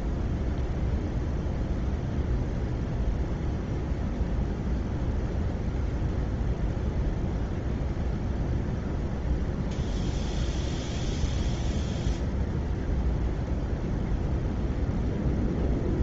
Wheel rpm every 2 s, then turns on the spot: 0, 0, 0, 0, 0, 0, 0, 0.
none